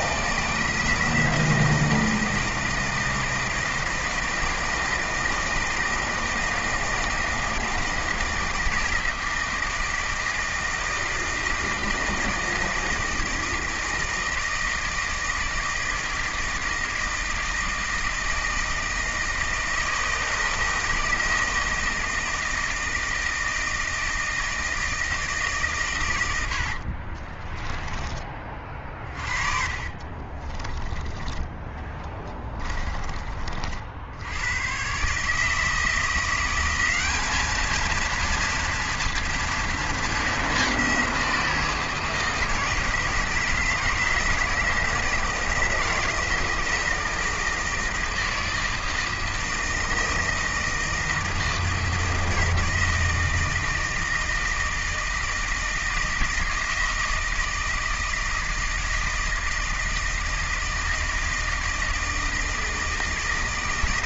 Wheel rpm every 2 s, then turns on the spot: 160, 160, 160, 160, 160, 160, 160, 160, 160, 160, 160, 160, 160, 80, 30, 30, 20, 110, 180, 230, 200, 160, 160, 160, 160, 160, 160, 160, 160, 160, 160, 160.
30-34